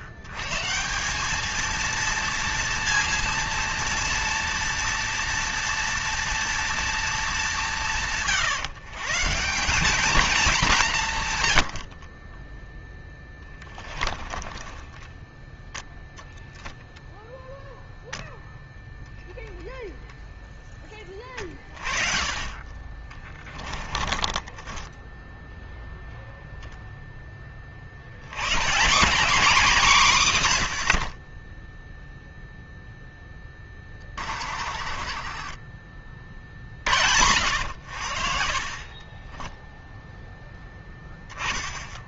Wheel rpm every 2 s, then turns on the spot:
100, 230, 230, 230, 150, 200, 30, 30, 0, 0, 0, 30, 20, 0, 130, 150, 0, 40, 30, 50, 10.
14-16 24-26 34-36 38-40